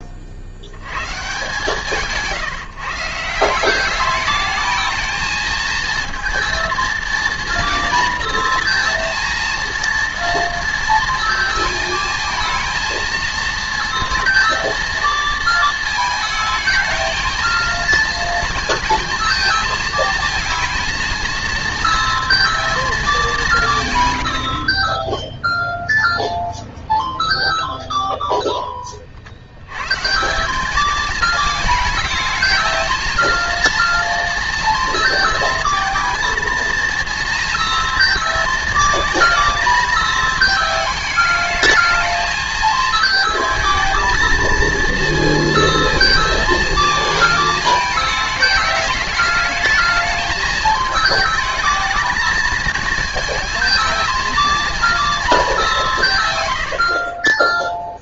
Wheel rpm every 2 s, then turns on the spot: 90, 160, 220, 230, 230, 230, 220, 230, 220, 230, 230, 220, 20, 0, 20, 200, 220, 230, 230, 220, 220, 220, 230, 220, 210, 220, 220, 230, 90.
none